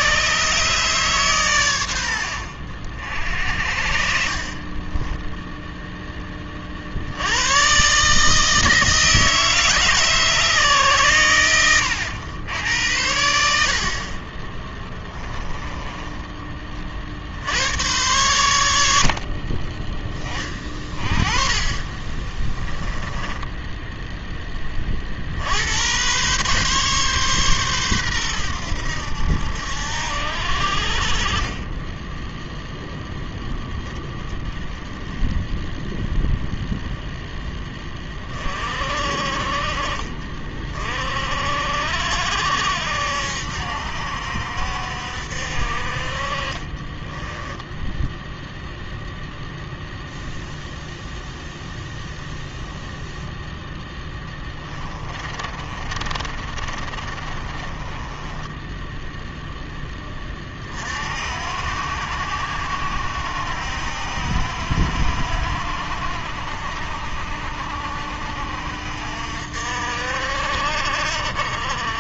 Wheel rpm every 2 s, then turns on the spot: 140, 60, 30, 50, 160, 140, 90, 20, 40, 80, 30, 20, 20, 130, 90, 70, 0, 0, 0, 40, 40, 70, 60, 30, 0, 0, 0, 20, 30, 10, 40, 70, 70, 60, 60, 50.
4-6 14-16 22-24 46-48 54-60